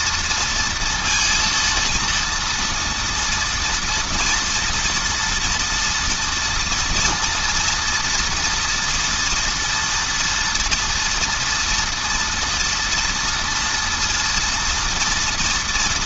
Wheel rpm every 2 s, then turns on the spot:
230, 230, 230, 230, 230, 230, 240, 240.
none